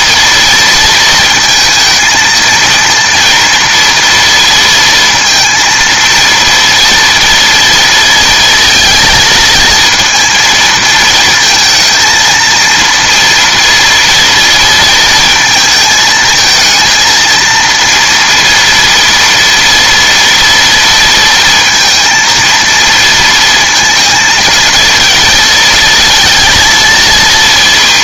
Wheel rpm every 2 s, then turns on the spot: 230, 230, 230, 230, 230, 220, 230, 230, 230, 230, 230, 230, 230, 230.
none